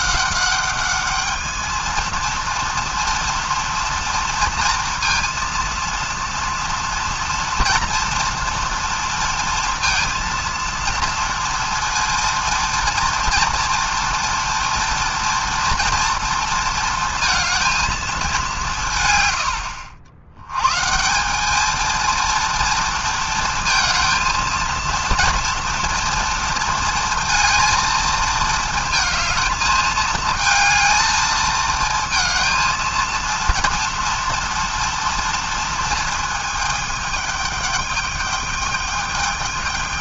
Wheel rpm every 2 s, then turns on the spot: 200, 230, 230, 230, 230, 230, 230, 230, 230, 180, 150, 230, 230, 230, 220, 220, 230, 230, 220, 210.
none